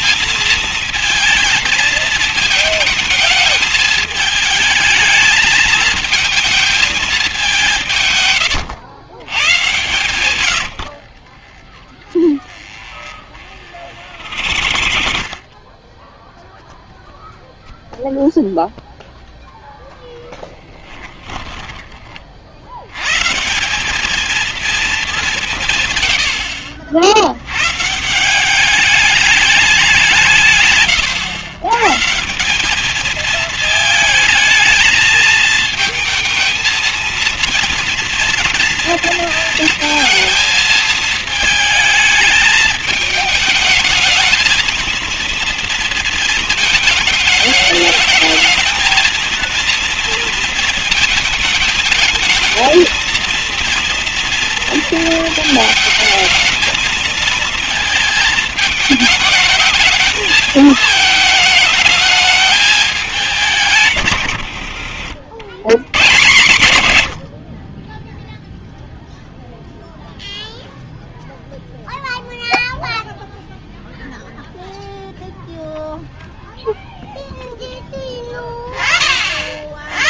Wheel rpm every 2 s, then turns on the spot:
230, 220, 220, 220, 140, 120, 20, 60, 0, 0, 10, 40, 220, 80, 180, 160, 180, 220, 220, 230, 220, 210, 220, 230, 220, 230, 220, 230, 220, 220, 220, 220, 110, 140, 0, 0, 0, 0, 0, 10.
10-16 20-22